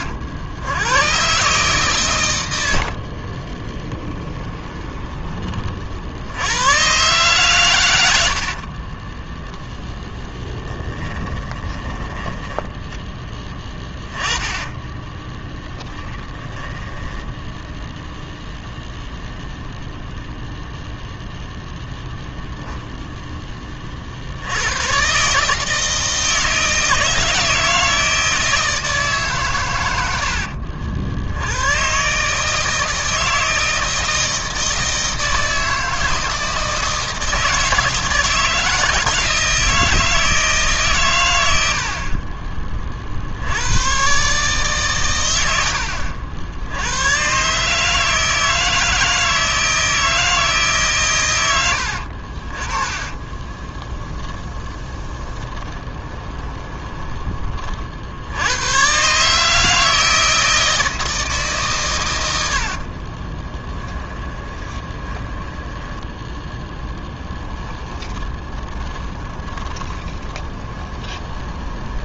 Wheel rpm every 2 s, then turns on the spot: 100, 90, 20, 110, 40, 10, 10, 10, 10, 10, 0, 0, 110, 160, 160, 70, 160, 160, 160, 160, 150, 30, 140, 90, 160, 140, 20, 20, 20, 120, 160, 50, 20, 10, 20, 20.
2-6 8-12 14-18 52-58 62-72